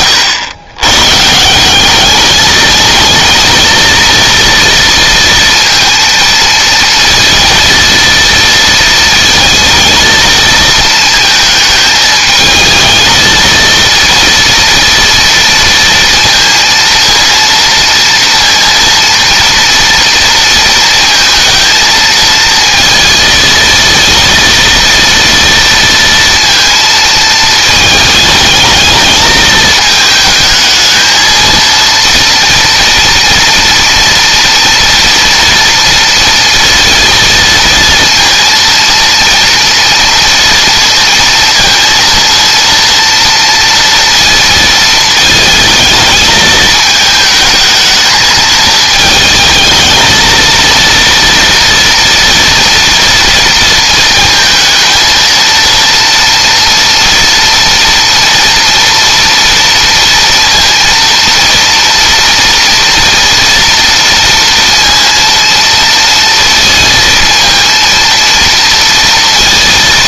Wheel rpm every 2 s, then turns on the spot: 130, 220, 230, 230, 230, 220, 220, 230, 230, 230, 230, 230, 230, 230, 220, 220, 230, 230, 230, 230, 230, 230, 230, 220, 220, 230, 240, 230, 230, 230, 230, 230, 230, 230, 230.
none